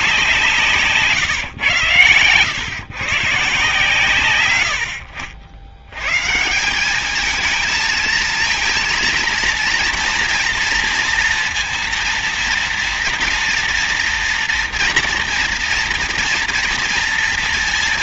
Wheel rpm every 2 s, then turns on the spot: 160, 110, 100, 190, 230, 230, 230, 230, 230.
none